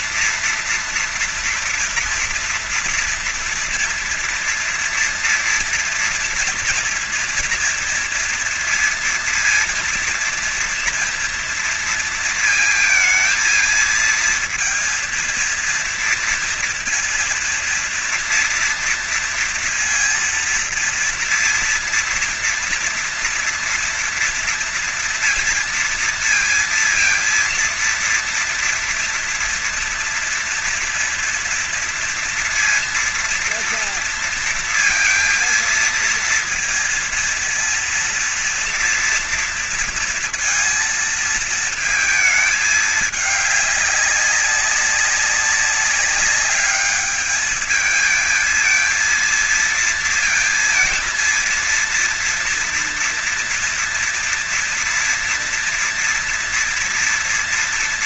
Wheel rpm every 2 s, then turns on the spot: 230, 230, 230, 230, 230, 230, 230, 230, 230, 230, 230, 230, 230, 230, 230, 230, 240, 230, 230, 230, 230, 220, 200, 200, 220, 230, 230, 230, 230.
none